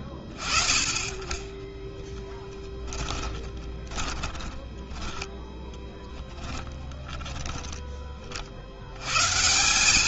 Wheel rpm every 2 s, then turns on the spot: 20, 20, 10, 10, 60.
2-8